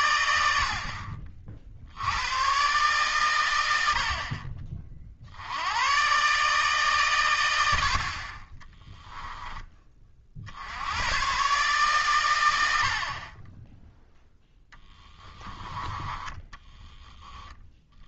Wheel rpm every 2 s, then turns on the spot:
60, 130, 40, 140, 20, 80, 80, 20, 10.
8-10 14-18